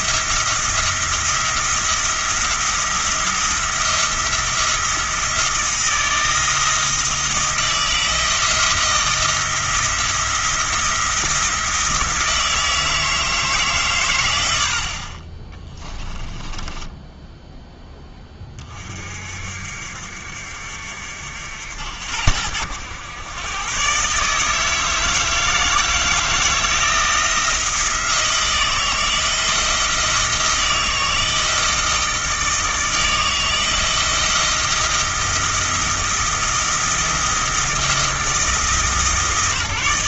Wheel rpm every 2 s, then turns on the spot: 170, 170, 170, 160, 170, 170, 160, 50, 10, 30, 60, 80, 160, 170, 160, 160, 160, 170, 160, 160.
16-18